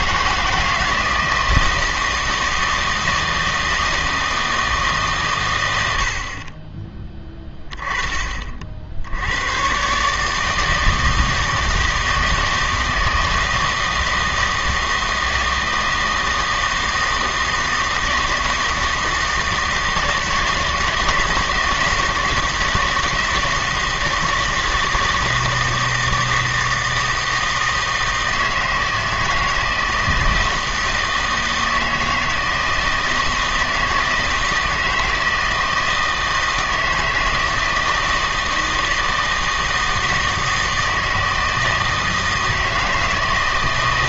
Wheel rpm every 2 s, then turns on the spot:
170, 160, 160, 30, 50, 160, 160, 160, 160, 160, 170, 160, 160, 160, 160, 160, 160, 160, 160, 160, 160, 160.
none